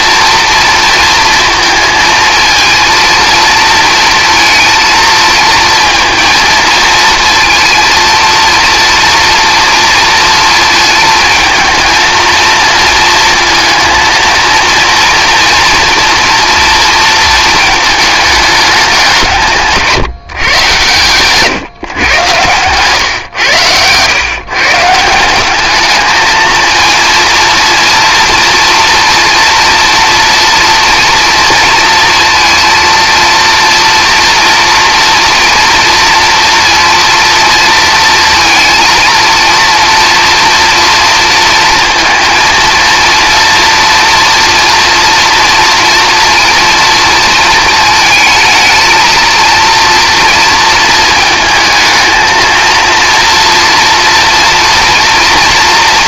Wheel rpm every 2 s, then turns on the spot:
230, 220, 230, 230, 230, 230, 230, 230, 230, 210, 140, 130, 140, 220, 230, 230, 230, 230, 230, 230, 230, 230, 230, 230, 220, 230, 230, 230.
22-24